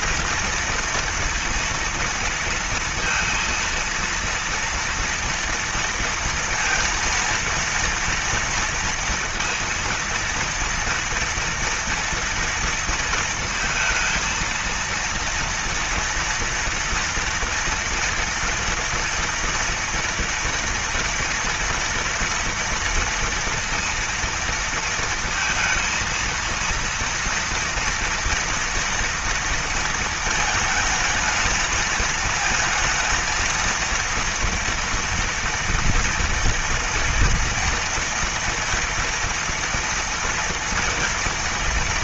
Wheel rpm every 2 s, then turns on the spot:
230, 230, 230, 230, 230, 230, 230, 230, 230, 230, 230, 230, 230, 230, 230, 220, 220, 230, 230, 230, 230.
none